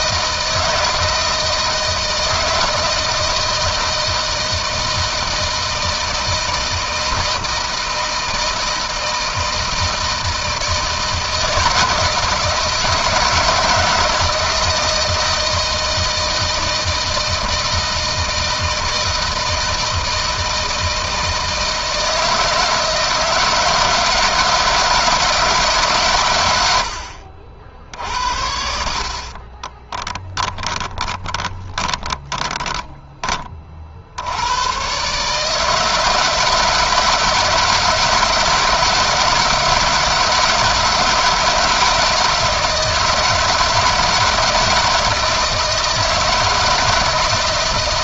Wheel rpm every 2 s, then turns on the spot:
160, 160, 160, 160, 160, 160, 160, 160, 160, 160, 160, 160, 160, 100, 60, 20, 20, 110, 160, 160, 160, 160, 160, 160.
30-34